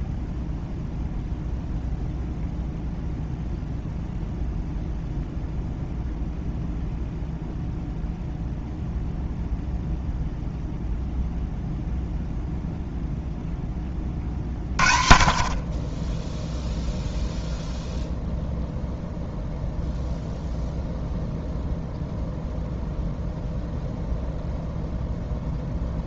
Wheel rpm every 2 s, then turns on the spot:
0, 0, 0, 0, 0, 0, 60, 0, 0, 0, 0, 0, 0.
none